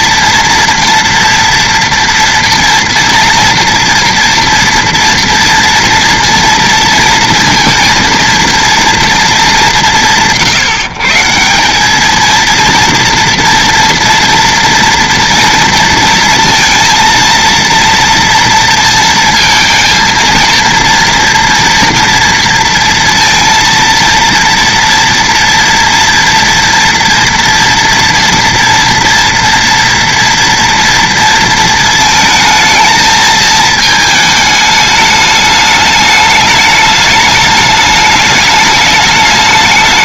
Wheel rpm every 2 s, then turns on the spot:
230, 240, 230, 230, 230, 150, 230, 230, 230, 230, 230, 230, 230, 230, 230, 230, 220, 210, 210, 210.
none